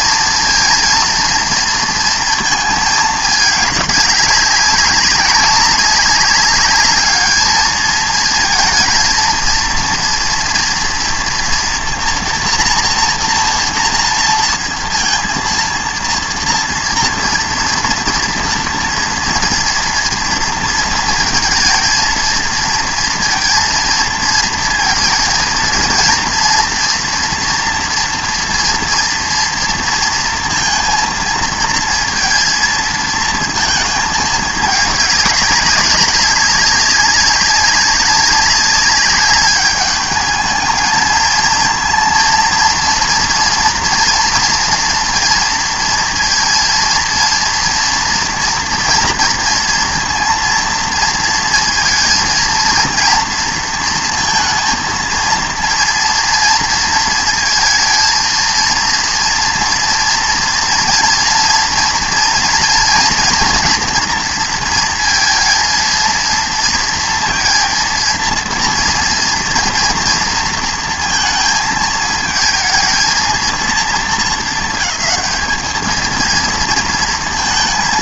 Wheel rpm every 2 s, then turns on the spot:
230, 230, 200, 200, 220, 230, 240, 230, 230, 230, 230, 230, 230, 230, 230, 230, 230, 210, 190, 200, 220, 230, 230, 230, 230, 230, 230, 220, 230, 230, 230, 240, 230, 230, 230, 230, 220, 220, 220.
none